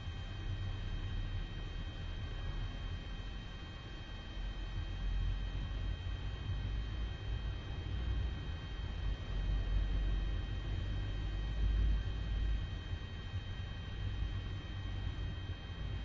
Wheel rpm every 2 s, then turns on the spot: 0, 0, 0, 0, 0, 0, 0, 0.
none